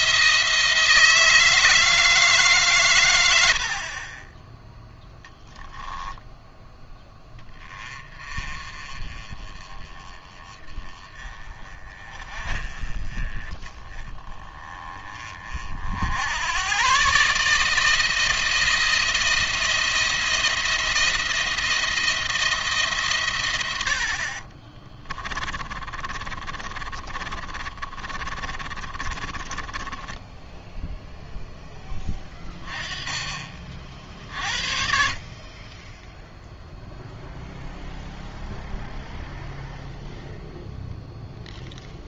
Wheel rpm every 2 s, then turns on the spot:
160, 150, 10, 10, 30, 20, 30, 20, 100, 170, 170, 160, 40, 30, 30, 10, 20, 60, 0, 0, 0.
24-32